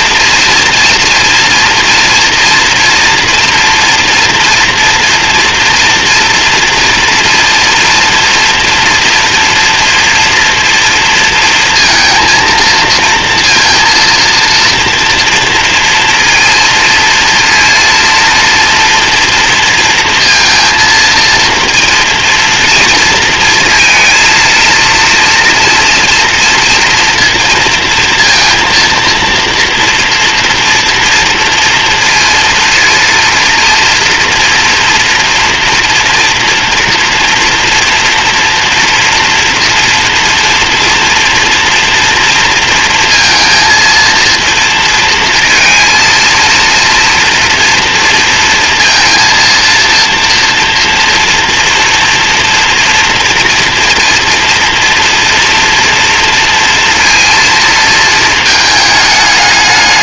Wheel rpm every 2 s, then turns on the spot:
230, 240, 230, 240, 240, 230, 230, 230, 230, 230, 230, 220, 230, 230, 230, 230, 230, 240, 230, 240, 230, 230, 230, 230, 230, 230, 230, 230, 230, 210.
none